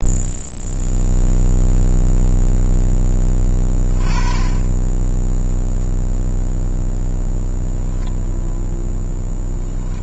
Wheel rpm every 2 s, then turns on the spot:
0, 0, 10, 0, 0.
none